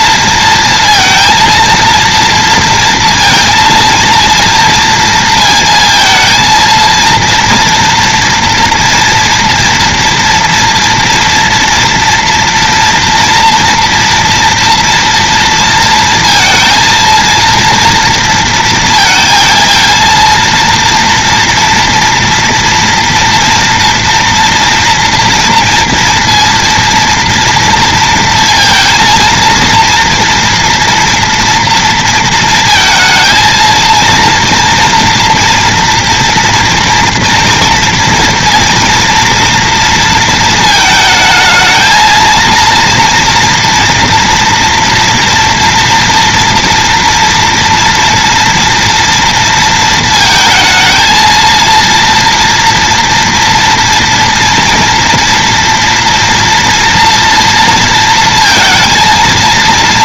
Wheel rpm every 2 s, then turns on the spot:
230, 230, 230, 230, 240, 230, 240, 230, 230, 230, 230, 230, 230, 230, 230, 230, 230, 230, 230, 230, 220, 230, 230, 230, 240, 230, 240, 230, 230, 230.
none